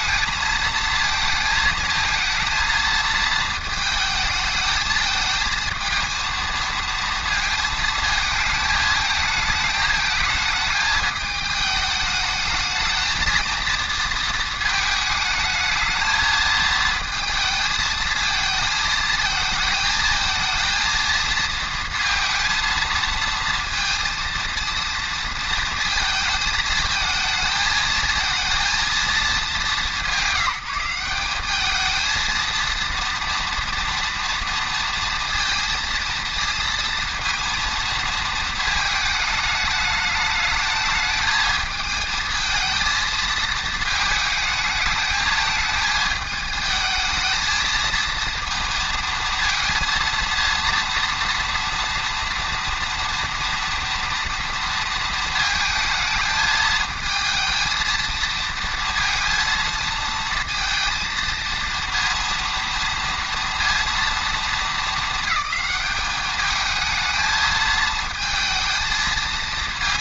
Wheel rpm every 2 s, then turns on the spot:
220, 220, 220, 230, 220, 220, 220, 220, 220, 220, 230, 230, 230, 220, 230, 180, 230, 230, 230, 220, 220, 220, 220, 220, 230, 230, 230, 230, 220, 230, 230, 230, 220, 220, 220.
none